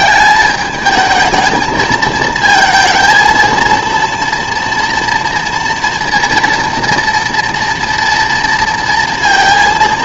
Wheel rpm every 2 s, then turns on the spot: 190, 220, 230, 230, 230.
none